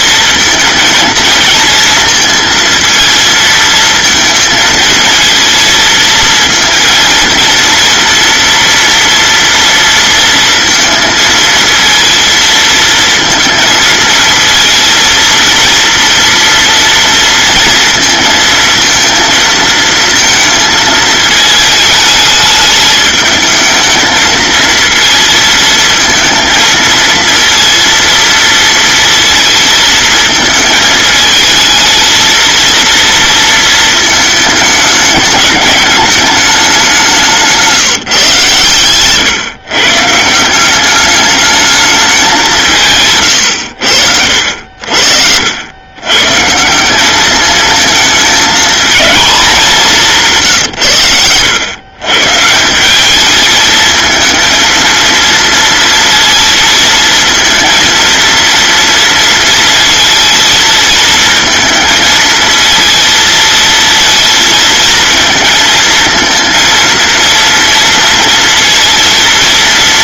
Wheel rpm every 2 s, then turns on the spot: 220, 230, 220, 230, 230, 230, 220, 230, 230, 230, 220, 210, 230, 230, 230, 220, 230, 210, 190, 120, 200, 140, 60, 200, 220, 110, 190, 230, 220, 230, 220, 230, 230, 230, 230.
44-46